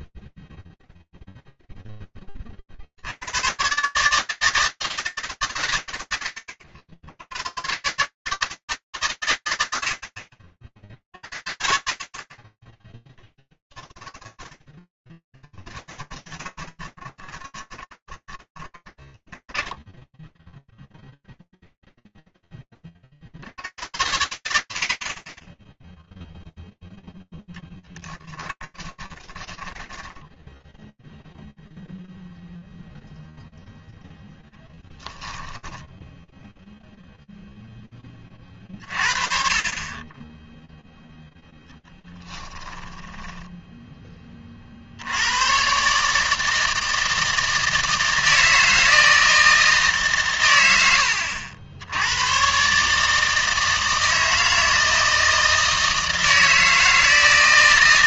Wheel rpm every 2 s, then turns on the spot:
0, 70, 160, 90, 140, 60, 40, 10, 10, 20, 10, 0, 90, 0, 10, 10, 0, 10, 0, 40, 0, 10, 90, 160, 160, 90, 150, 160, 160.
14-22 28-32 42-44